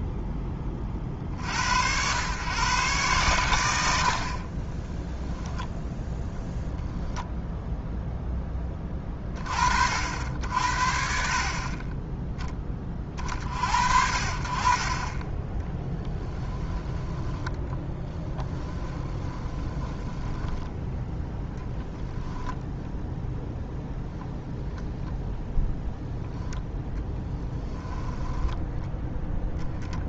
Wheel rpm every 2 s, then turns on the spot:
30, 120, 20, 10, 40, 70, 20, 40, 20, 20, 10, 0, 0, 20, 10.
16-22 26-30